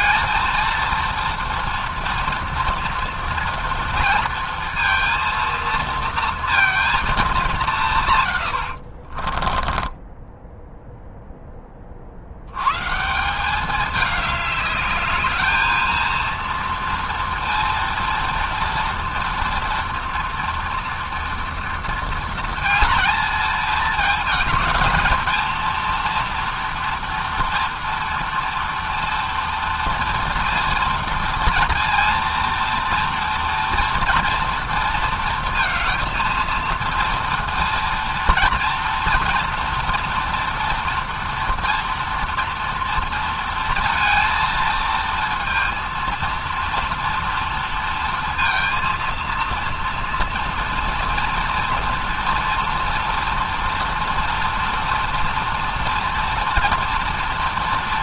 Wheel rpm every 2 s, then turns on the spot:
230, 240, 230, 210, 20, 10, 180, 210, 230, 230, 230, 220, 230, 240, 240, 230, 230, 230, 230, 230, 240, 230, 230, 230, 230, 230, 230, 230, 230.
8-10